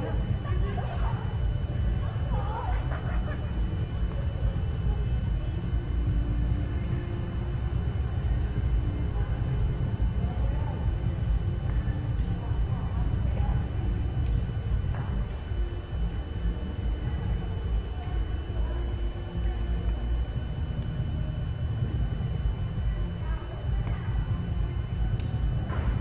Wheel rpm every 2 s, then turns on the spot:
0, 0, 0, 0, 0, 0, 0, 0, 0, 0, 0, 0, 0.
none